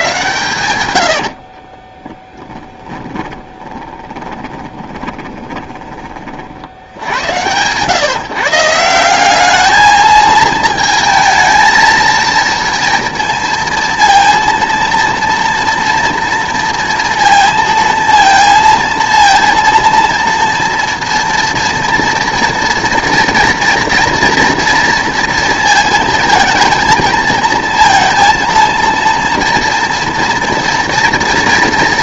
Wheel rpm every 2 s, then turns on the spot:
110, 10, 20, 70, 170, 220, 230, 230, 230, 230, 230, 240, 230, 220, 230, 230.
2-6